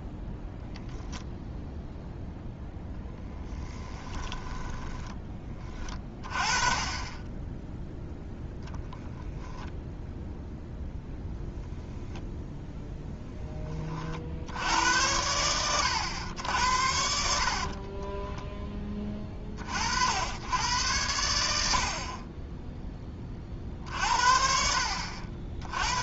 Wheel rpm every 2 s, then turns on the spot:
0, 0, 10, 20, 0, 0, 0, 80, 90, 10, 100, 10, 70.
4-6